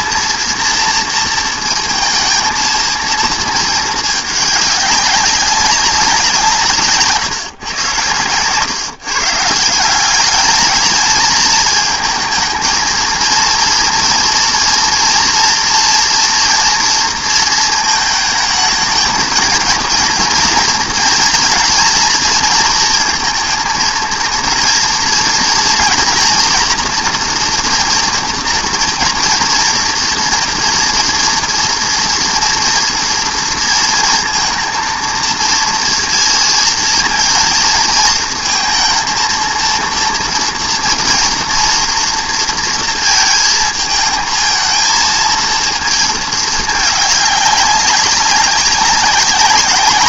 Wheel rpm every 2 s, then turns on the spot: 230, 230, 200, 160, 130, 210, 230, 230, 230, 220, 230, 230, 230, 240, 240, 230, 230, 230, 230, 220, 230, 230, 220, 210, 190.
none